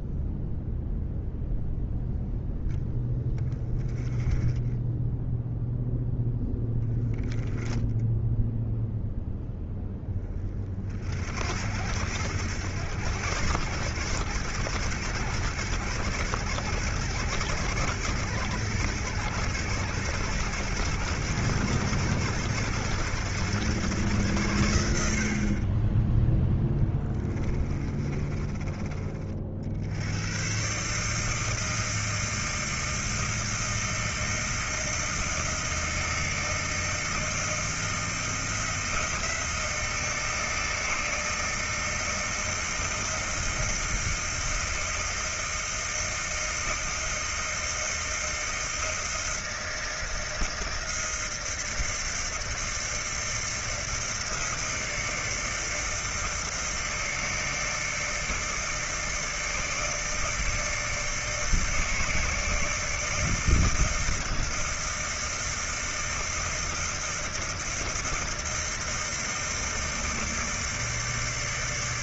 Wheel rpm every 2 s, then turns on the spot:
0, 0, 10, 0, 0, 50, 100, 110, 110, 110, 120, 110, 90, 10, 30, 140, 160, 160, 160, 160, 160, 160, 160, 160, 160, 160, 160, 160, 160, 160, 160, 160, 160, 160, 160, 160.
26-28